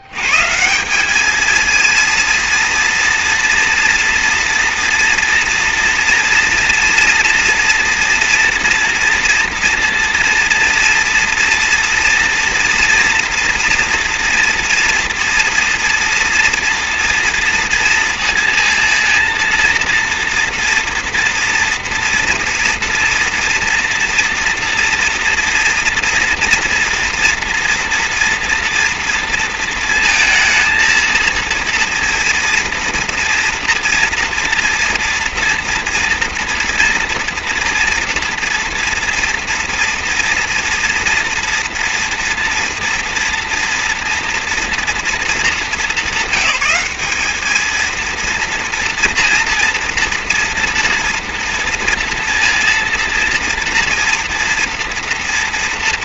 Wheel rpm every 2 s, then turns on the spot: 110, 230, 240, 230, 240, 230, 230, 240, 230, 230, 230, 230, 230, 230, 230, 230, 230, 230, 240, 230, 230, 230, 240, 200, 230, 230, 230, 240.
none